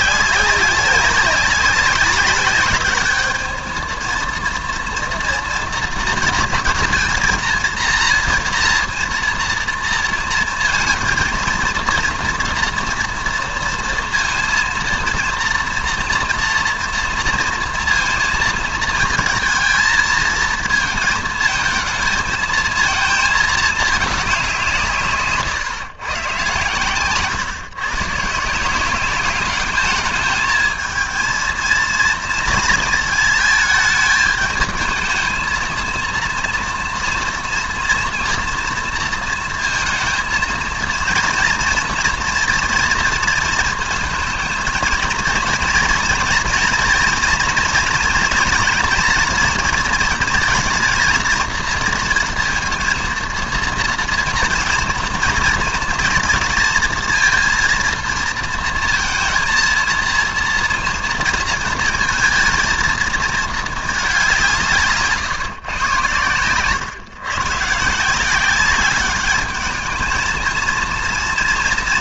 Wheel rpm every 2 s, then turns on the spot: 190, 210, 230, 230, 230, 230, 230, 230, 230, 230, 230, 230, 170, 130, 180, 220, 230, 220, 230, 230, 230, 230, 230, 230, 230, 230, 230, 230, 230, 230, 230, 220, 150, 120, 200, 230.
none